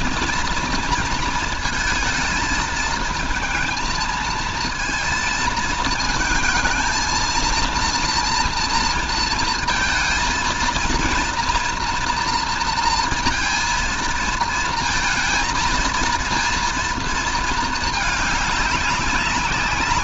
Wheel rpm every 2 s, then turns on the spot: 230, 230, 230, 230, 230, 230, 230, 230, 230, 200.
none